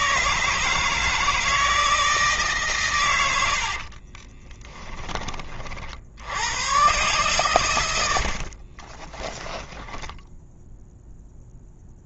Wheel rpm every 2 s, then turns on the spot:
160, 150, 20, 100, 60, 0.
4-6 8-10